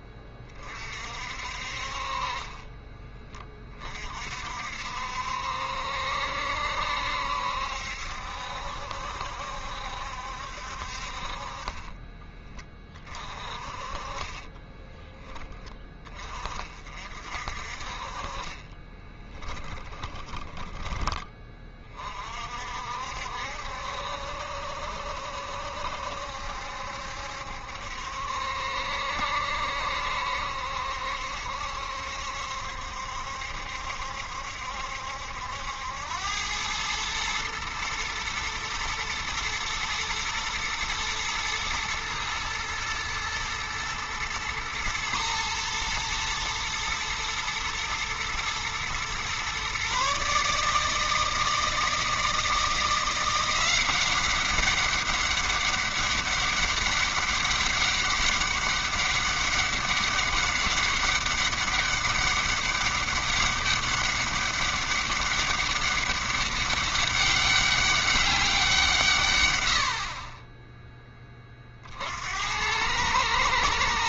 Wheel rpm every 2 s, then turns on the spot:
30, 30, 60, 70, 70, 60, 20, 20, 40, 30, 10, 50, 70, 70, 70, 70, 70, 70, 100, 110, 110, 110, 110, 110, 120, 150, 170, 200, 200, 200, 200, 200, 200, 200, 170, 20, 90.
2-4 14-16 18-20